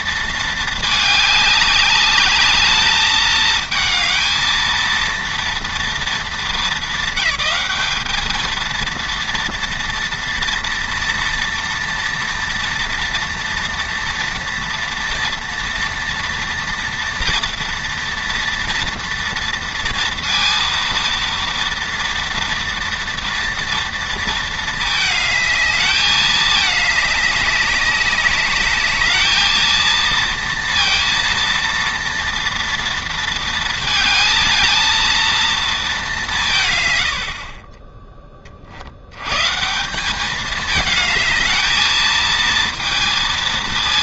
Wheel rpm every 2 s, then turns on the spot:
210, 220, 230, 220, 230, 230, 230, 230, 230, 230, 230, 230, 210, 200, 220, 230, 230, 230, 50, 130, 220, 230.
none